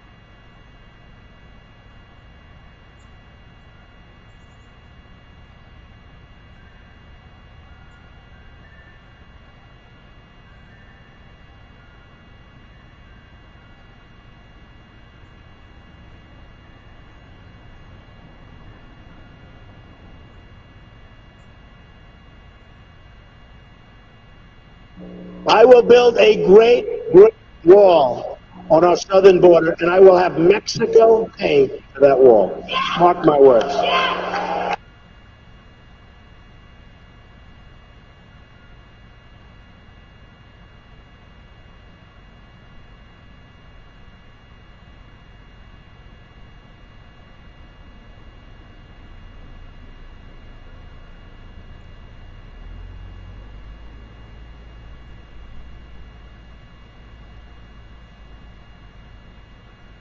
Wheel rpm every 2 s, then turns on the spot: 0, 0, 0, 0, 0, 0, 0, 0, 0, 0, 0, 0, 0, 0, 0, 0, 0, 0, 0, 0, 0, 0, 0, 0, 0, 0, 0, 0, 0, 0.
none